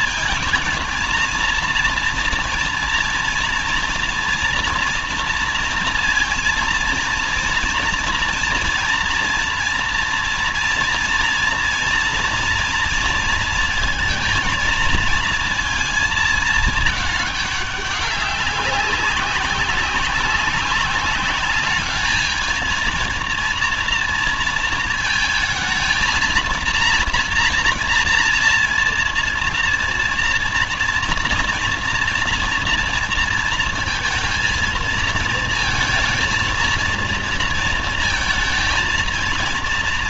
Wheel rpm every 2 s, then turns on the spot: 230, 230, 240, 230, 230, 240, 230, 230, 220, 200, 190, 220, 230, 230, 230, 230, 230, 230, 230, 220.
none